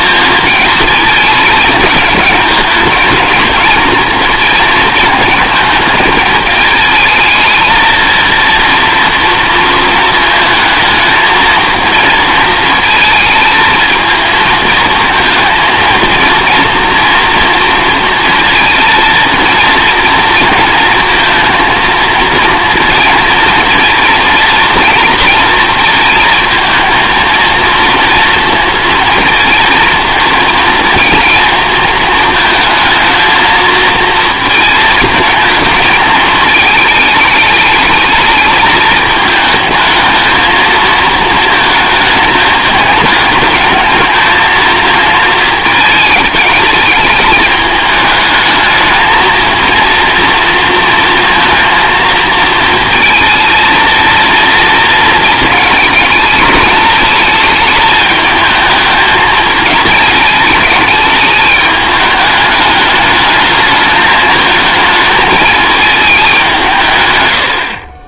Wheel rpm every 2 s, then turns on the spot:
220, 220, 230, 220, 230, 220, 230, 230, 230, 230, 230, 230, 230, 230, 230, 220, 220, 230, 220, 220, 220, 210, 220, 210, 220, 230, 230, 230, 220, 220, 210, 210, 220, 170.
none